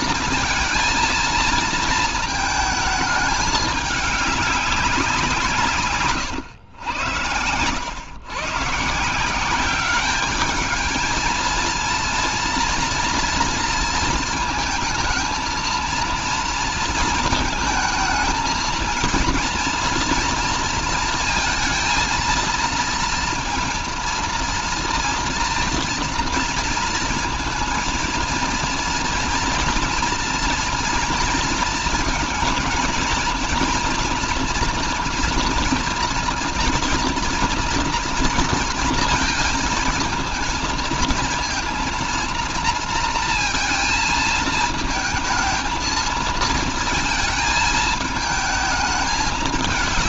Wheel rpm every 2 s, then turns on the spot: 230, 220, 180, 100, 160, 220, 230, 220, 220, 230, 230, 230, 230, 230, 230, 230, 230, 230, 230, 230, 230, 230, 220, 220, 220.
6-8